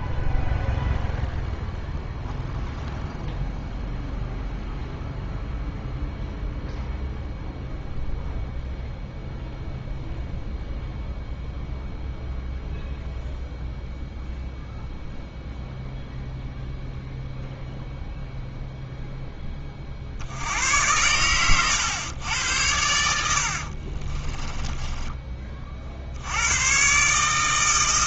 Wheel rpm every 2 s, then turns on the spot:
0, 0, 0, 0, 0, 0, 0, 0, 0, 0, 80, 100, 20, 100.
24-26